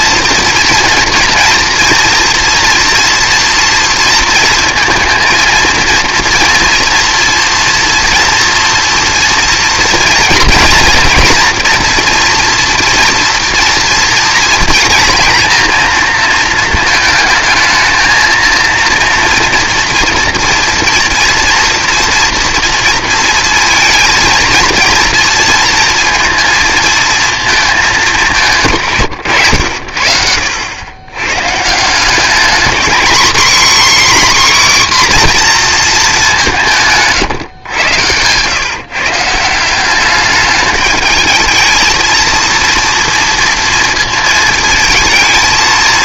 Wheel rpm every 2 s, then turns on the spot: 230, 230, 230, 230, 230, 230, 230, 230, 230, 230, 230, 230, 230, 230, 170, 80, 230, 270, 180, 130, 210, 230, 230.
none